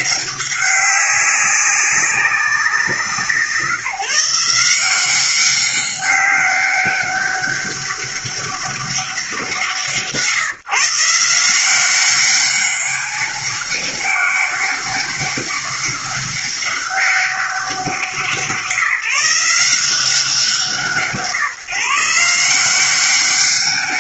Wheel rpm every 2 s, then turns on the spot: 200, 190, 170, 200, 200, 160, 200, 200, 200, 170, 180, 170.
none